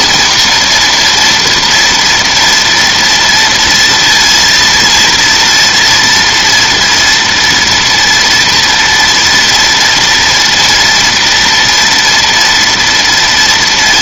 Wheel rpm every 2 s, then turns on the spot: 240, 230, 230, 230, 230, 230, 230.
none